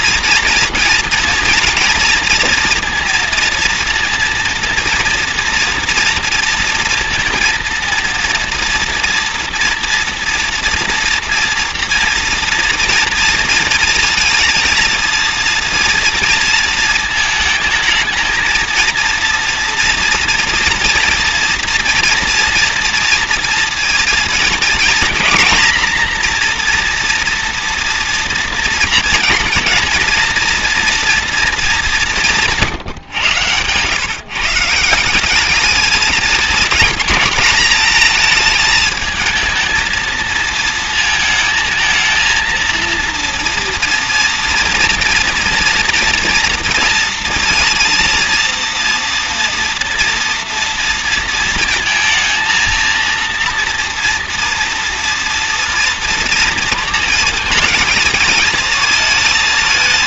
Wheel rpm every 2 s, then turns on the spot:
230, 230, 230, 230, 230, 230, 230, 230, 230, 230, 230, 230, 230, 240, 230, 230, 140, 160, 220, 220, 230, 230, 230, 230, 230, 230, 230, 230, 230, 220.
none